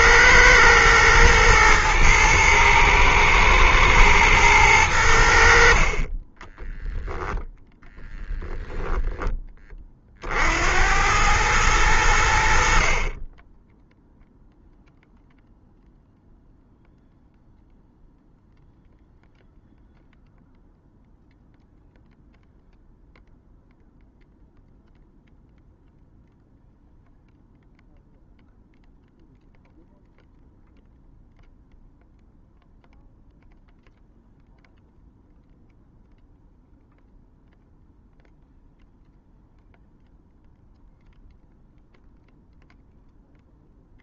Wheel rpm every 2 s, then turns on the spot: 110, 110, 80, 10, 10, 90, 40, 0, 0, 0, 0, 0, 0, 0, 0, 0, 0, 0, 0, 0, 0, 0.
8-10